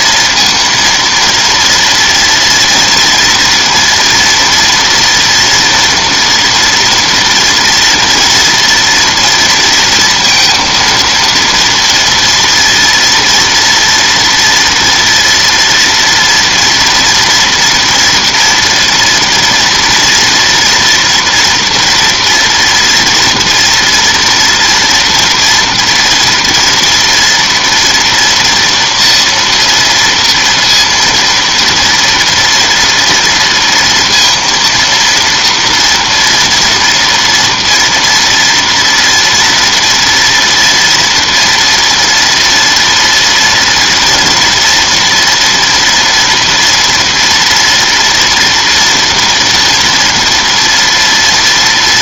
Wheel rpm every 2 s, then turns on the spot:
230, 230, 240, 230, 230, 230, 230, 230, 230, 230, 230, 230, 230, 230, 230, 230, 240, 230, 230, 230, 230, 230, 240, 240, 230, 230.
none